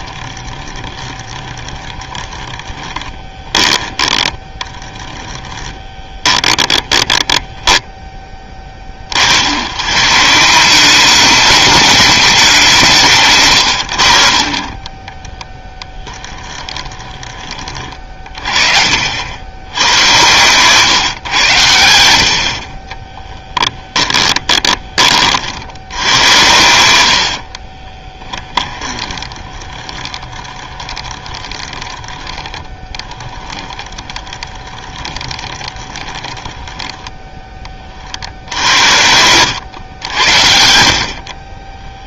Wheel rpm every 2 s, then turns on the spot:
20, 20, 20, 20, 30, 190, 170, 20, 20, 50, 120, 30, 20, 80, 20, 20, 10, 20, 10, 80, 60.
0-8 16-18 22-24 26-38